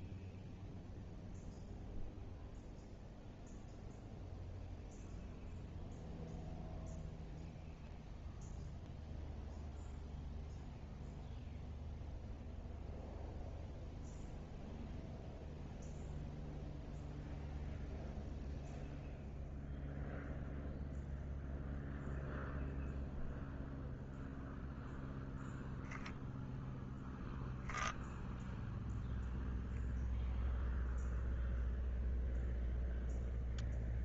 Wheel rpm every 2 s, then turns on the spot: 0, 0, 0, 0, 0, 0, 0, 0, 0, 0, 0, 0, 0, 0, 0, 0, 0.
none